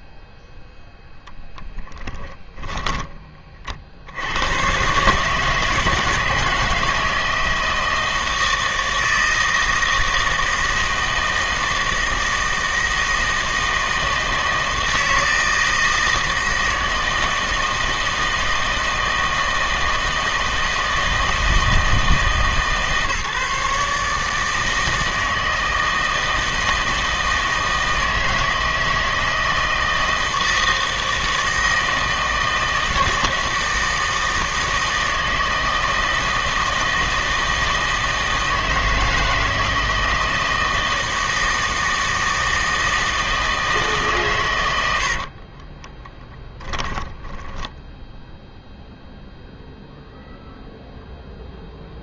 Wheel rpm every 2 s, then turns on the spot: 0, 10, 120, 160, 160, 160, 160, 160, 160, 160, 160, 150, 160, 160, 160, 160, 160, 160, 160, 160, 160, 160, 100, 10, 0, 0.
2-4 46-48